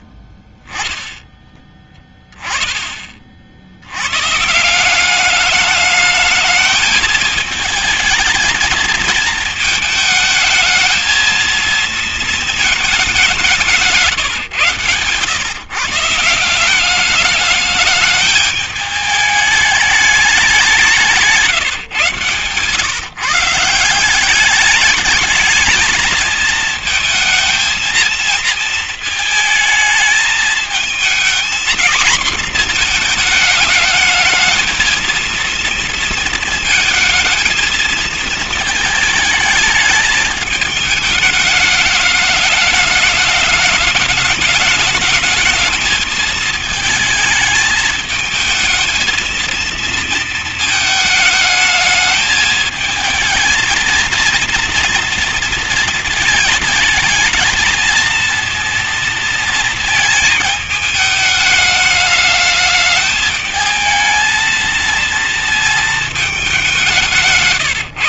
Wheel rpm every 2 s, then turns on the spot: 10, 10, 160, 210, 220, 220, 220, 150, 180, 210, 200, 130, 190, 220, 230, 220, 230, 220, 220, 220, 210, 210, 210, 220, 220, 220, 220, 230, 220, 230, 220, 210, 230, 200.
none